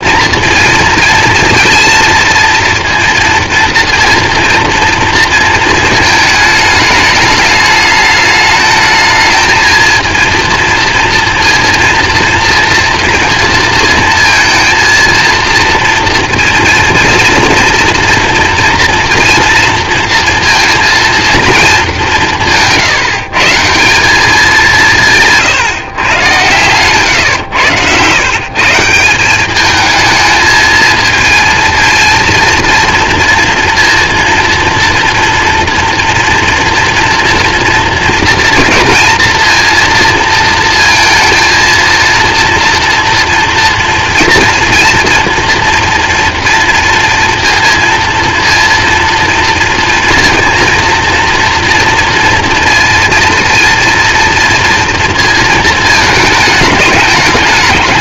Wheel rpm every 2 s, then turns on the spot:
230, 230, 230, 220, 220, 230, 230, 230, 230, 240, 230, 170, 170, 110, 150, 220, 230, 230, 230, 230, 230, 230, 240, 230, 230, 230, 230, 230, 210.
26-28